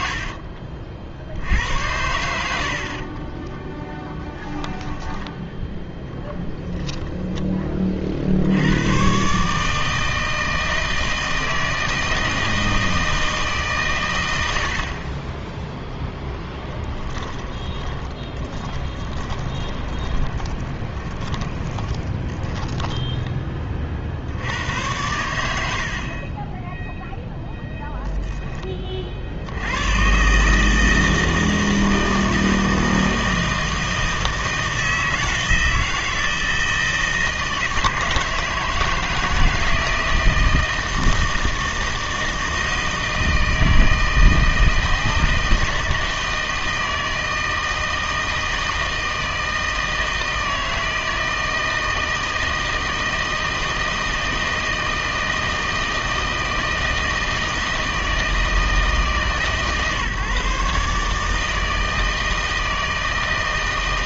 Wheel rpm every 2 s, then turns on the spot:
50, 70, 10, 0, 80, 160, 160, 70, 10, 20, 20, 10, 90, 20, 10, 150, 160, 160, 160, 160, 160, 160, 160, 160, 160, 160, 160, 160, 160, 160, 150, 160.
0-2 4-6 16-24 26-28